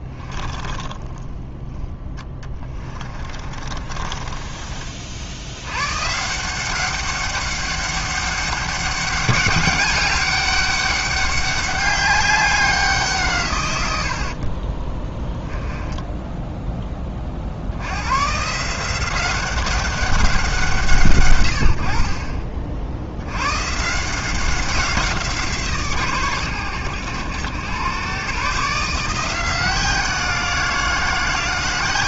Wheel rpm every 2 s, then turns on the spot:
10, 20, 40, 180, 200, 200, 190, 20, 10, 160, 180, 50, 180, 100, 150, 170.
0-4